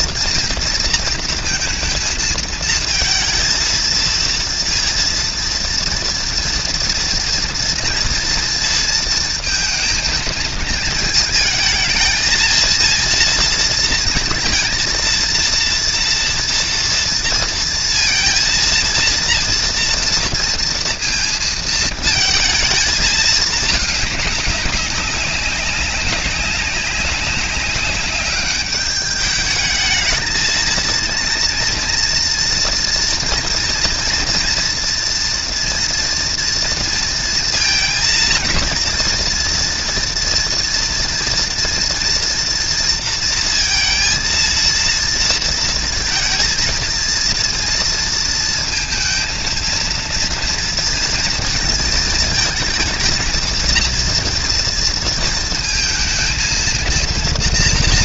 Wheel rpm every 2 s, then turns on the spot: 230, 230, 230, 230, 230, 220, 230, 230, 240, 230, 230, 220, 200, 200, 200, 230, 240, 230, 230, 230, 230, 230, 230, 230, 230, 230, 220, 230, 230.
none